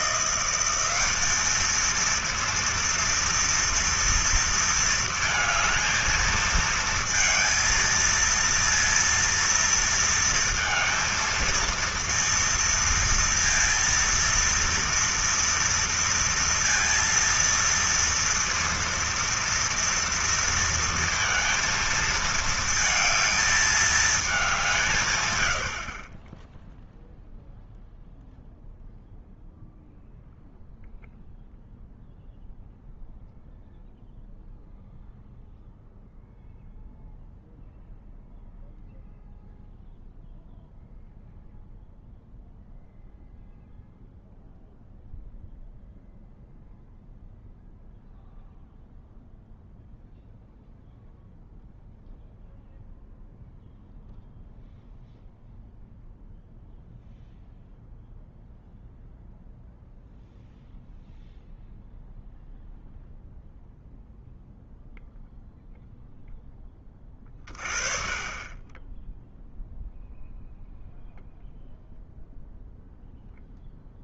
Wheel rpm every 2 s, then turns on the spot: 190, 230, 230, 220, 230, 230, 230, 230, 230, 230, 230, 220, 170, 0, 0, 0, 0, 0, 0, 0, 0, 0, 0, 0, 0, 0, 0, 0, 0, 0, 0, 0, 0, 10, 10, 0, 0.
none